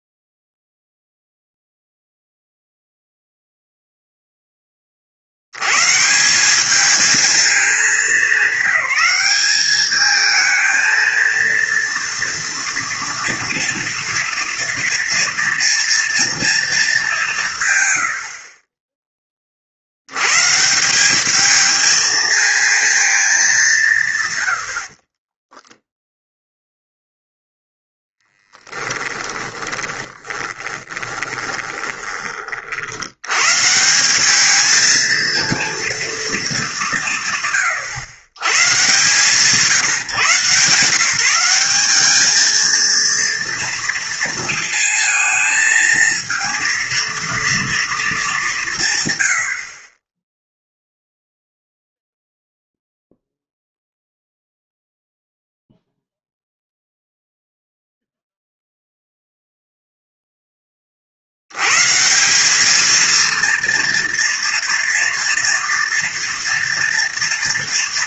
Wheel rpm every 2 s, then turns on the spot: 0, 0, 20, 200, 200, 220, 230, 230, 220, 30, 150, 230, 90, 0, 10, 30, 50, 220, 200, 130, 150, 220, 230, 230, 180, 0, 0, 0, 0, 0, 20, 210, 230, 230.
28-32